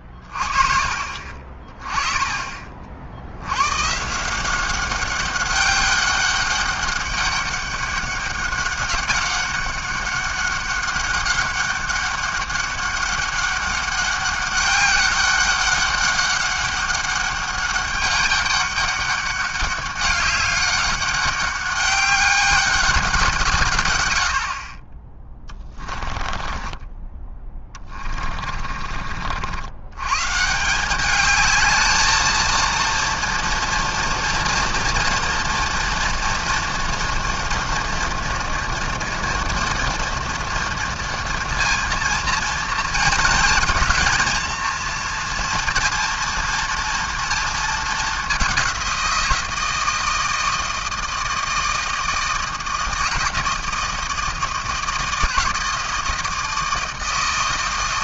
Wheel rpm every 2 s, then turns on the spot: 30, 40, 190, 200, 200, 200, 200, 200, 200, 200, 200, 190, 30, 20, 40, 170, 230, 240, 240, 230, 230, 230, 230, 230, 190, 160, 160, 160, 160.
26-30